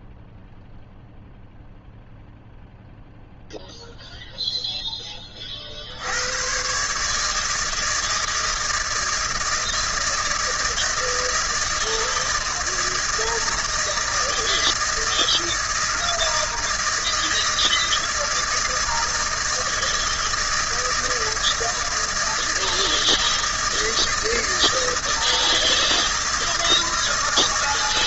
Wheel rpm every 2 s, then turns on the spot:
0, 0, 0, 120, 160, 160, 160, 160, 160, 160, 160, 160, 160, 160.
none